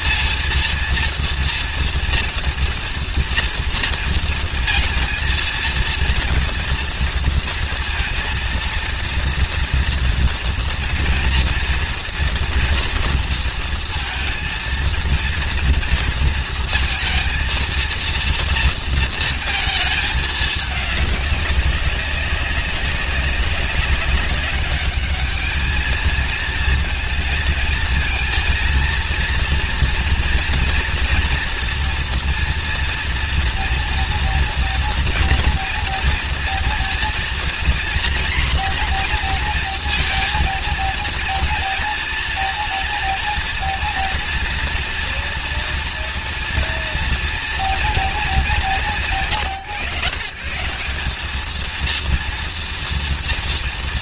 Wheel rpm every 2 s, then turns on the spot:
230, 230, 230, 230, 230, 240, 230, 230, 230, 230, 210, 200, 200, 230, 230, 230, 230, 230, 230, 240, 230, 230, 230, 230, 150, 160, 230.
none